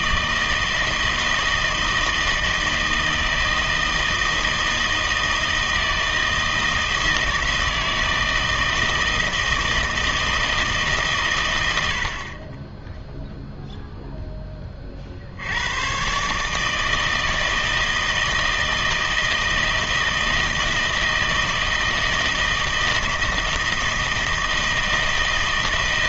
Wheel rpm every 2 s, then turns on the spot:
160, 160, 160, 160, 160, 150, 10, 30, 160, 160, 160, 160, 160.
none